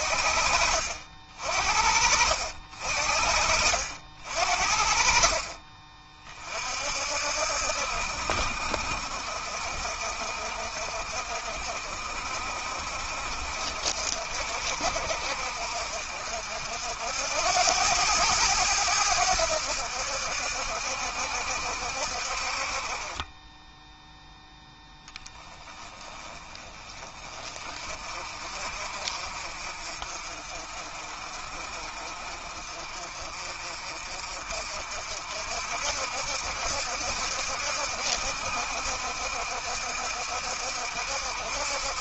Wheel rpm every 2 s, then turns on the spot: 50, 60, 40, 60, 60, 60, 60, 60, 80, 90, 70, 30, 10, 30, 40, 40, 40, 50, 70, 70, 70.
none